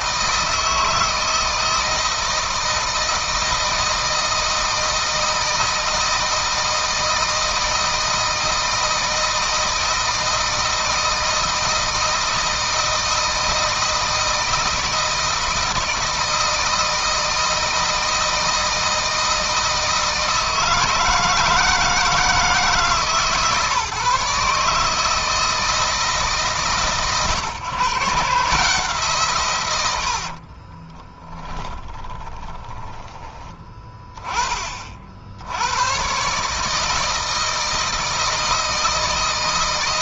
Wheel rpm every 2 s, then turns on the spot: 160, 160, 160, 160, 160, 160, 160, 160, 160, 160, 160, 150, 150, 140, 150, 50, 20, 30, 150, 160.
30-34